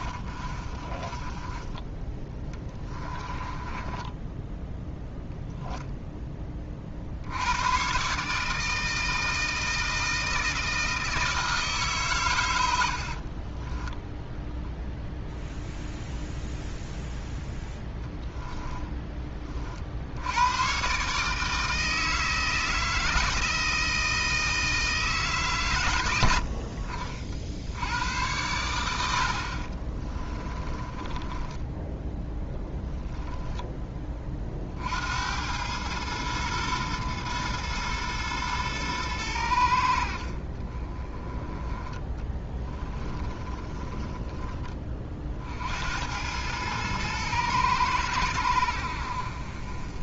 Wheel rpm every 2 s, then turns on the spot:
30, 20, 0, 40, 160, 160, 70, 0, 0, 10, 130, 160, 160, 60, 90, 20, 10, 60, 110, 110, 30, 10, 30, 110, 70.
0-4 12-14 18-20 30-34 42-44